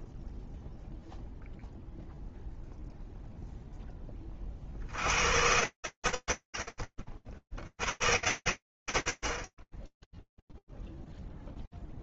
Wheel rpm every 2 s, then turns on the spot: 0, 0, 10, 70, 120, 0.
none